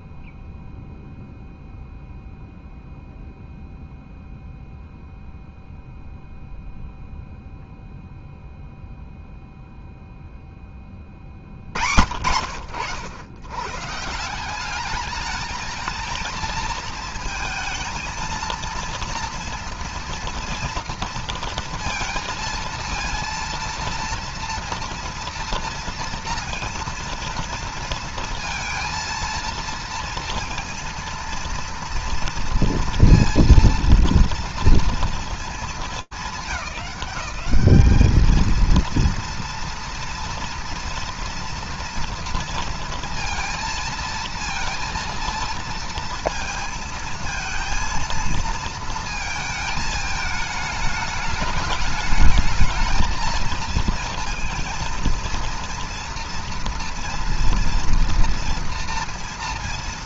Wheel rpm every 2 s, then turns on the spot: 0, 0, 0, 0, 0, 20, 80, 190, 230, 230, 230, 230, 230, 230, 230, 230, 230, 230, 210, 220, 230, 230, 230, 220, 230, 220, 220, 230, 230, 230.
none